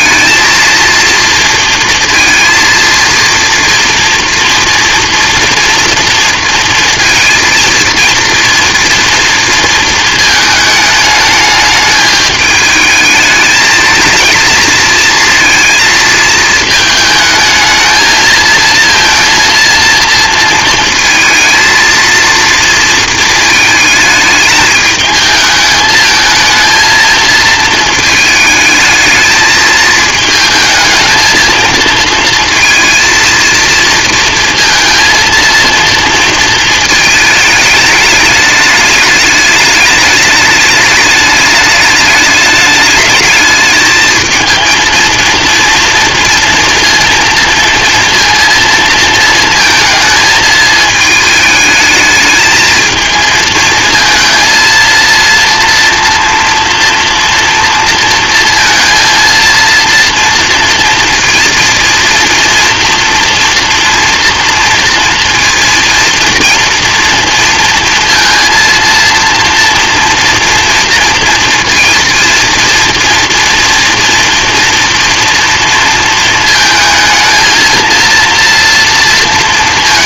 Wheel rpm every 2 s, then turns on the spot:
230, 230, 230, 230, 230, 220, 220, 220, 220, 220, 230, 230, 210, 220, 220, 220, 230, 230, 220, 210, 210, 210, 230, 230, 230, 220, 220, 230, 230, 230, 230, 230, 230, 230, 230, 230, 230, 230, 220, 230.
none